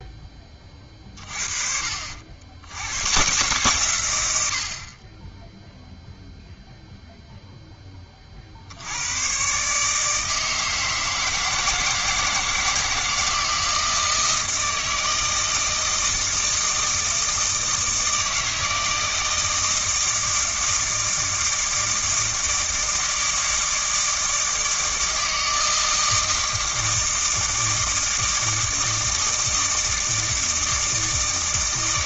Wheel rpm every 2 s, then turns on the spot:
40, 110, 50, 0, 90, 160, 160, 160, 160, 160, 160, 160, 160, 160, 160, 160.
none